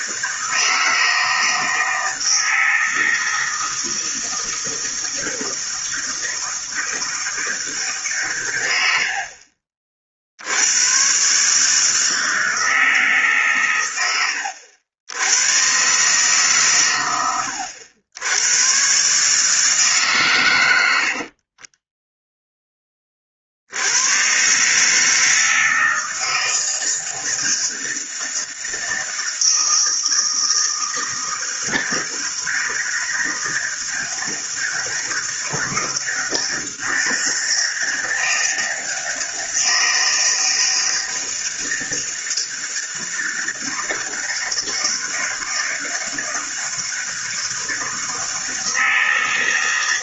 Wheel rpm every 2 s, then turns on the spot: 160, 160, 160, 160, 110, 80, 160, 90, 140, 110, 110, 10, 130, 160, 160, 160, 160, 160, 160, 160, 160, 160, 160, 160, 160.
none